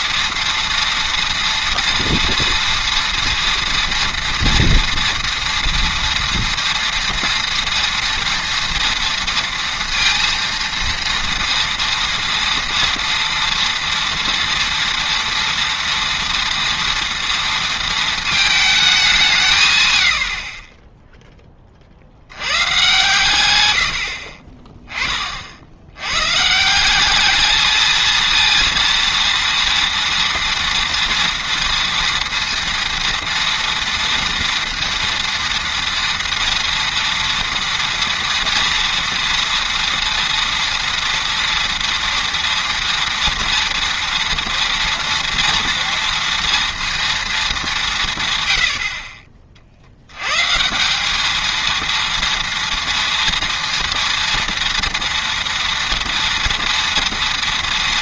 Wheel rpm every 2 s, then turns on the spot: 230, 240, 230, 230, 230, 230, 230, 230, 230, 210, 20, 110, 30, 170, 230, 230, 230, 230, 230, 230, 230, 230, 230, 230, 100, 160, 230, 230, 230.
none